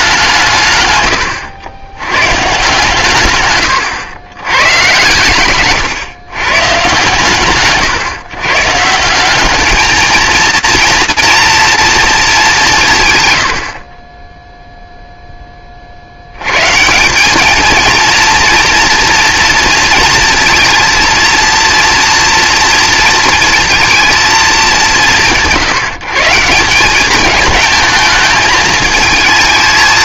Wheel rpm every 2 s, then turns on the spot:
130, 140, 110, 140, 160, 230, 160, 0, 160, 240, 230, 230, 190, 190, 220.
none